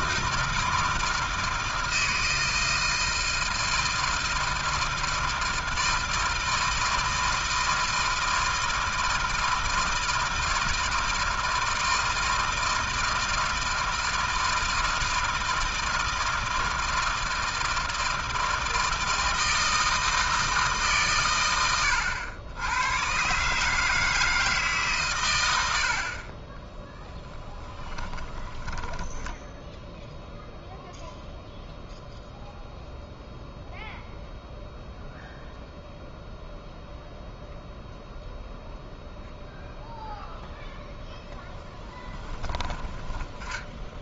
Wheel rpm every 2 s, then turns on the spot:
160, 160, 160, 160, 160, 160, 160, 160, 160, 160, 90, 150, 60, 10, 10, 0, 0, 0, 0, 0, 10, 20.
26-30 40-44